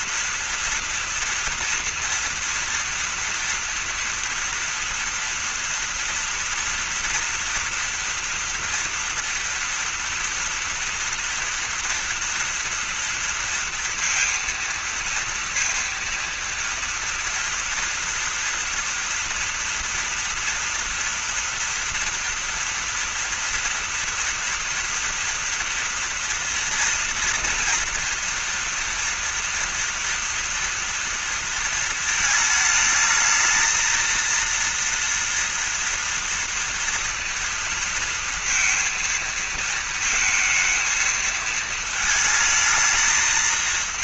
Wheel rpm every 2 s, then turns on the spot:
240, 230, 230, 230, 230, 230, 230, 230, 230, 240, 240, 230, 230, 230, 230, 230, 220, 230, 230, 230, 230, 220.
none